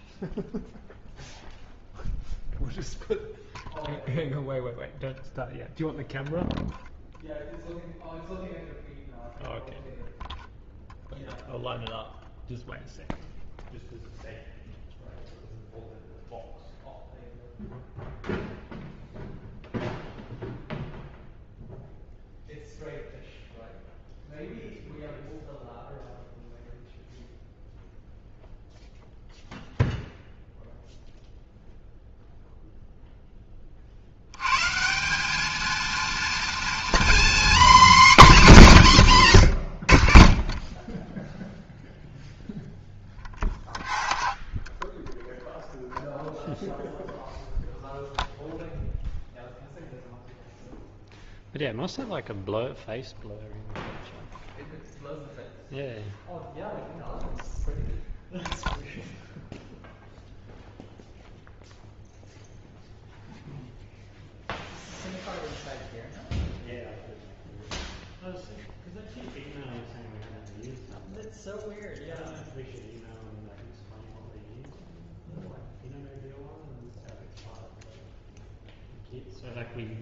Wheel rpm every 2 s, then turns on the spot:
0, 0, 0, 0, 0, 0, 0, 0, 0, 0, 0, 0, 0, 0, 0, 0, 0, 160, 240, 230, 30, 0, 0, 0, 0, 0, 0, 0, 0, 0, 0, 0, 0, 0, 0, 0, 0, 0, 0, 0.
none